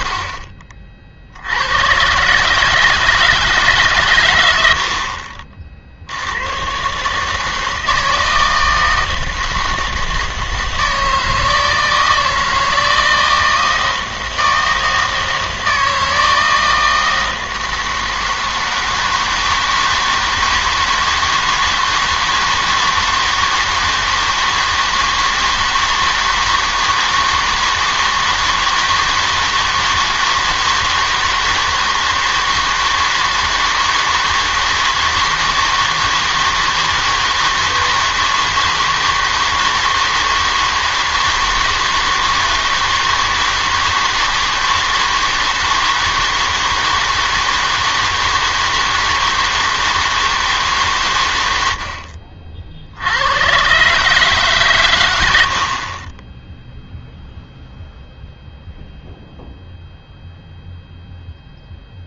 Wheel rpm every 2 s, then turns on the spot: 50, 160, 90, 100, 160, 160, 160, 160, 160, 160, 160, 160, 160, 160, 160, 160, 160, 160, 160, 160, 160, 160, 160, 160, 160, 150, 60, 130, 0, 0, 0.
none